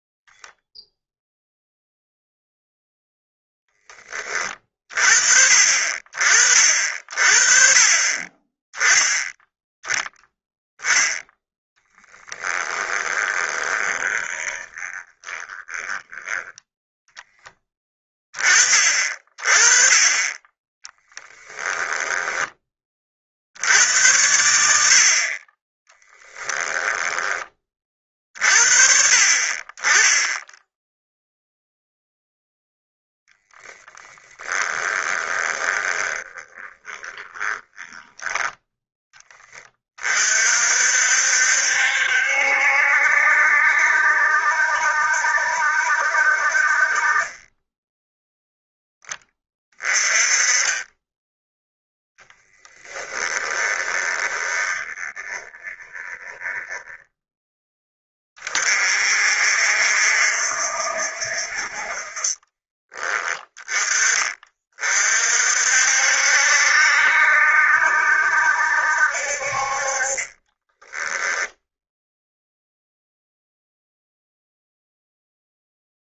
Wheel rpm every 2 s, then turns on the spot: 0, 0, 50, 40, 10, 10, 20, 20, 10, 30, 10, 30, 60, 10, 50, 0, 10, 20, 20, 10, 60, 70, 70, 40, 10, 10, 10, 20, 10, 50, 60, 20, 40, 70, 60, 10, 0, 0.
12-16 20-22 26-28 34-38 52-58 70-72